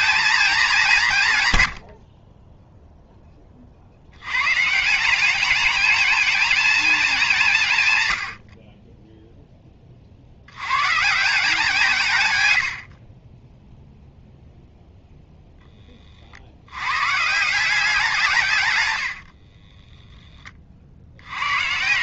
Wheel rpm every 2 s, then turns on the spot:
180, 0, 160, 210, 20, 120, 80, 0, 100, 100, 50.
none